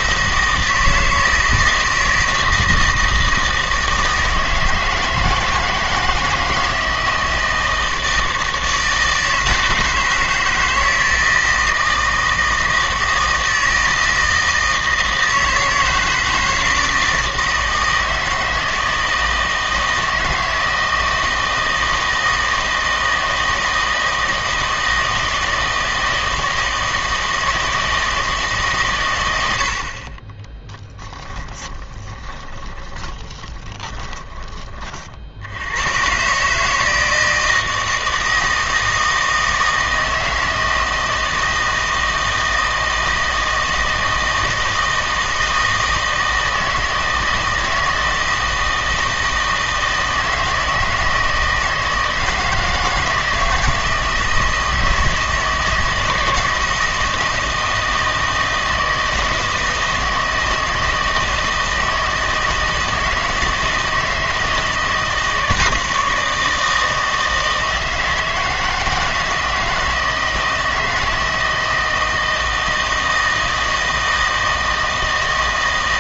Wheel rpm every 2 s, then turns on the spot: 160, 160, 160, 160, 160, 160, 160, 160, 160, 160, 160, 160, 160, 160, 140, 10, 10, 30, 150, 160, 160, 160, 160, 160, 160, 160, 160, 160, 160, 160, 160, 160, 170, 160, 160, 160, 160, 160.
30-34